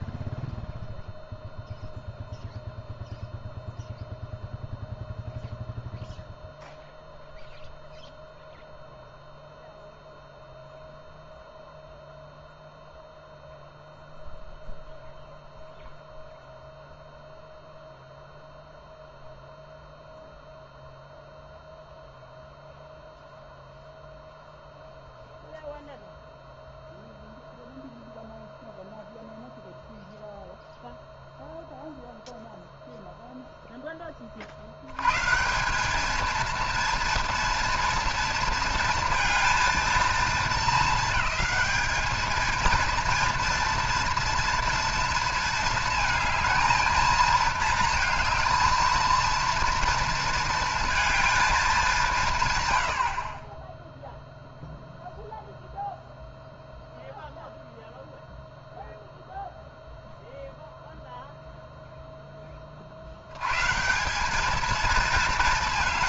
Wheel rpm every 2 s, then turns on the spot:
0, 0, 0, 0, 0, 0, 0, 0, 0, 0, 0, 0, 0, 0, 0, 0, 0, 70, 230, 230, 220, 230, 230, 220, 220, 230, 100, 0, 0, 0, 0, 40, 220.
none